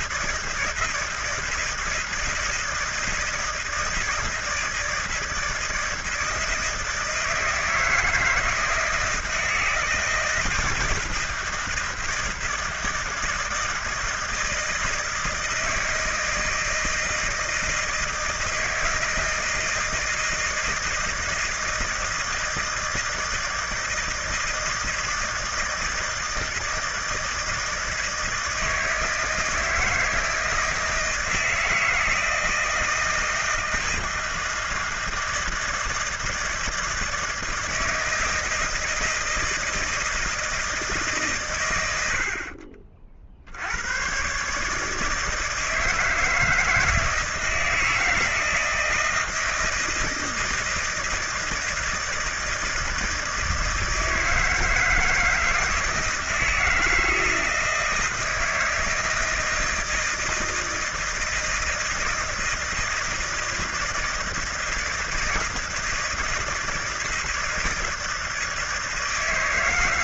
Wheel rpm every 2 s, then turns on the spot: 160, 160, 160, 160, 160, 160, 160, 160, 160, 160, 160, 160, 160, 160, 160, 160, 160, 160, 160, 160, 160, 50, 150, 160, 160, 160, 160, 160, 160, 160, 160, 160, 170, 160, 160.
none